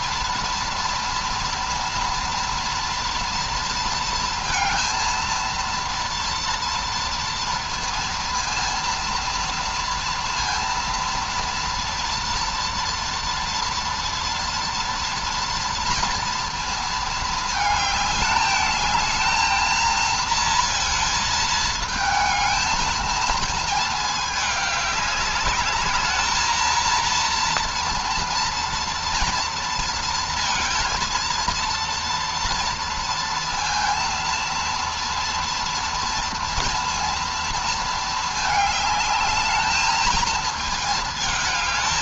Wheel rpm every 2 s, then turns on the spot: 230, 230, 230, 230, 230, 230, 230, 230, 230, 220, 230, 220, 210, 230, 230, 220, 230, 230, 230, 220, 220.
none